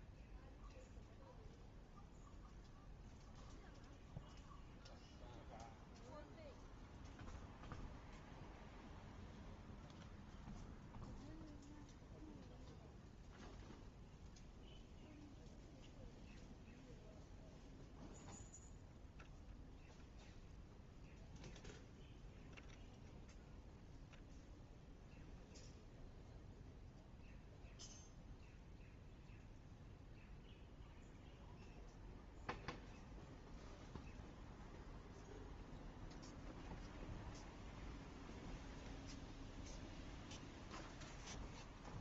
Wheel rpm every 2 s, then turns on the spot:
0, 0, 0, 0, 0, 0, 0, 0, 0, 0, 0, 0, 0, 0, 0, 0, 0, 0, 0, 0, 0.
none